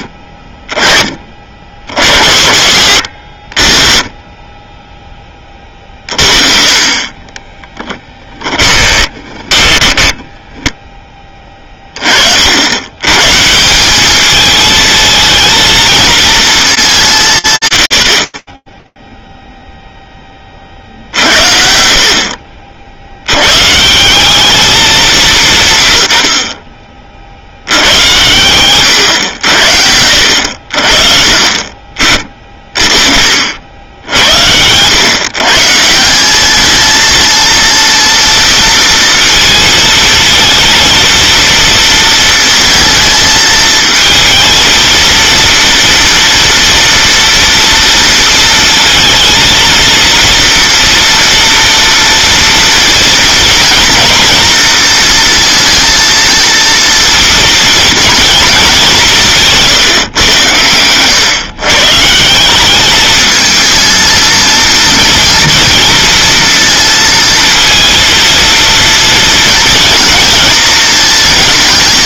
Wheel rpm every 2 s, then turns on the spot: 20, 80, 10, 40, 20, 10, 100, 220, 210, 10, 40, 60, 190, 40, 110, 50, 40, 120, 220, 230, 230, 220, 230, 230, 230, 240, 230, 230, 230, 190, 100, 210, 230, 230, 230, 220.
8-10